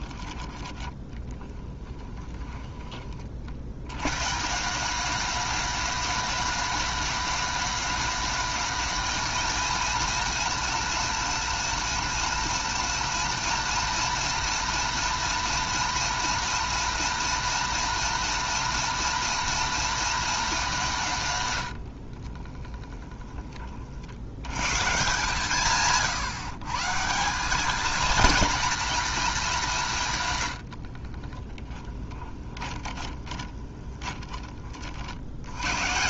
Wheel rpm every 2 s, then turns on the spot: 10, 10, 190, 210, 220, 210, 210, 230, 230, 230, 180, 10, 140, 150, 230, 60, 20, 60.
22-24 30-34